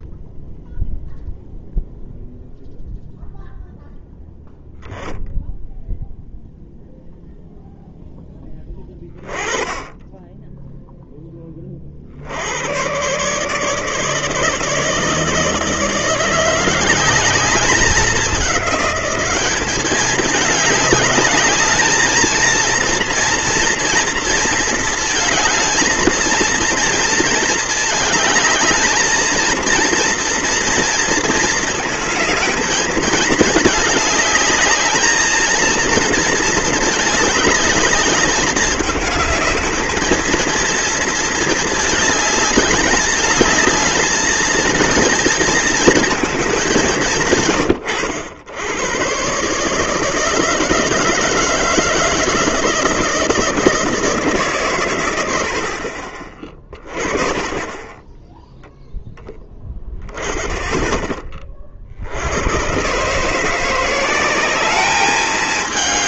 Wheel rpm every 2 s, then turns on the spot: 0, 0, 0, 0, 10, 10, 90, 150, 170, 200, 210, 230, 220, 220, 220, 230, 220, 210, 220, 210, 220, 210, 220, 200, 100, 160, 160, 140, 30, 0, 20, 110, 200.
none